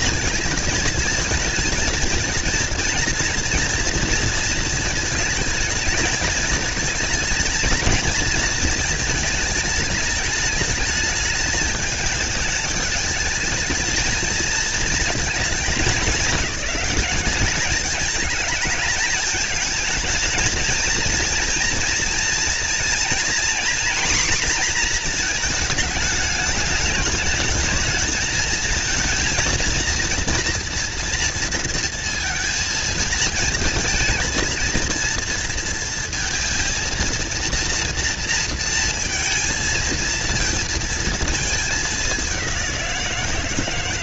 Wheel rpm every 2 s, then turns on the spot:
220, 230, 220, 220, 220, 210, 210, 230, 210, 220, 230, 240, 230, 210, 230, 230, 230, 230, 230, 230, 230, 180.
none